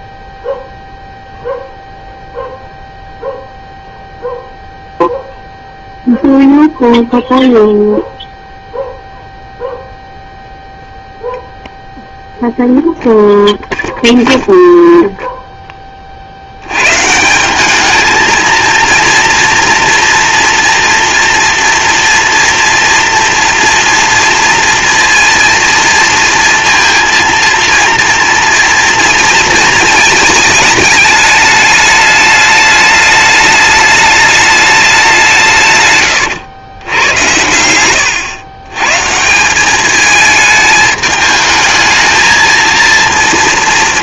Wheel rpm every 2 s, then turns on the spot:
0, 0, 0, 0, 0, 0, 0, 0, 120, 230, 240, 230, 230, 230, 230, 210, 210, 200, 110, 130, 210, 230.
none